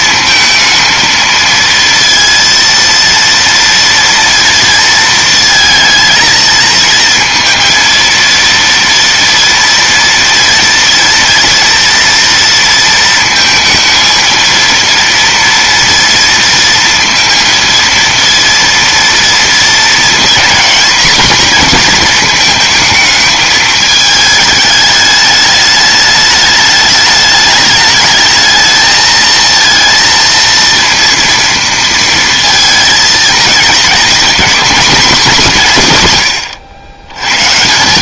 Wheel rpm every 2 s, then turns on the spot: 220, 230, 230, 230, 230, 230, 230, 230, 230, 230, 240, 220, 210, 210, 220, 230, 230, 230, 110.
none